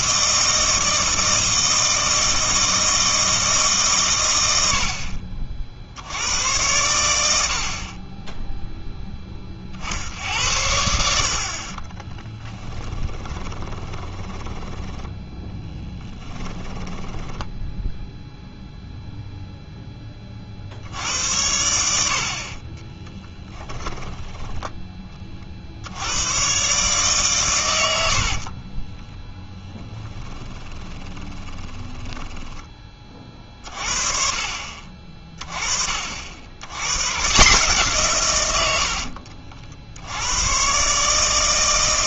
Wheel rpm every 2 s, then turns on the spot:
160, 160, 40, 80, 10, 70, 20, 10, 10, 0, 50, 40, 10, 120, 40, 20, 20, 40, 90, 100, 110.
12-18 22-24 28-32